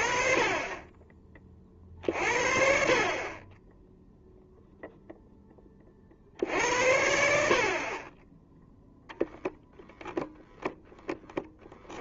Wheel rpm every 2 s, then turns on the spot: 30, 40, 0, 60, 10, 0.
none